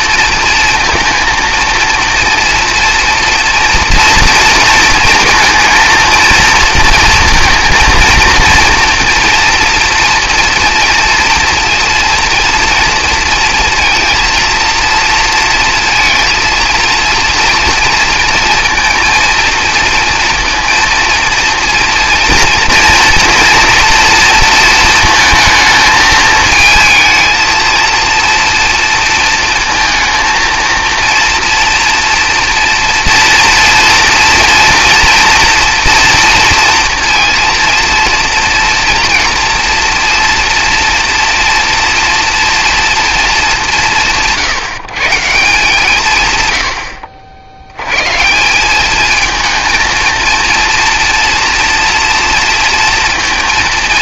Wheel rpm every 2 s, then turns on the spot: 230, 230, 230, 230, 230, 230, 240, 230, 220, 230, 230, 240, 230, 220, 230, 230, 230, 230, 230, 240, 240, 230, 140, 100, 190, 230, 230.
none